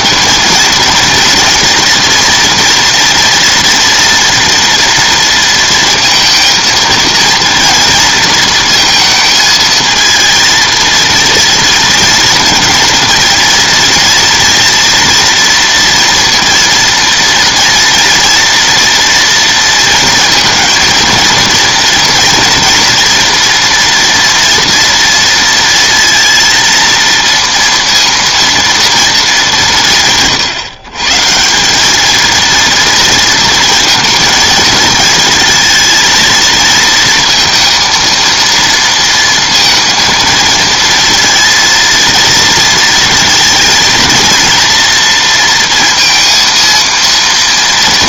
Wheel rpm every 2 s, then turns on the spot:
230, 230, 230, 230, 220, 230, 230, 230, 230, 230, 230, 230, 230, 230, 220, 140, 230, 220, 230, 230, 230, 230, 230, 230.
none